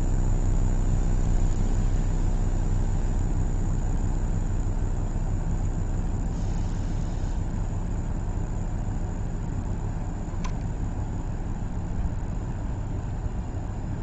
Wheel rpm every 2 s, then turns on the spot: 0, 0, 0, 0, 0, 0, 0.
none